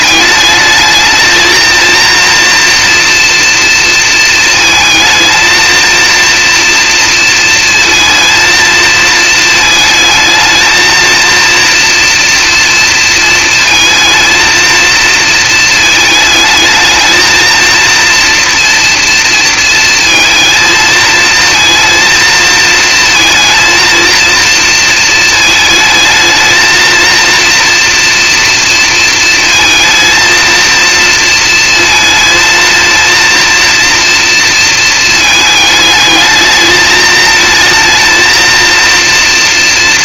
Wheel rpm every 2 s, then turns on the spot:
210, 230, 230, 230, 230, 220, 230, 230, 220, 230, 230, 230, 230, 220, 230, 230, 230, 230, 220, 230.
none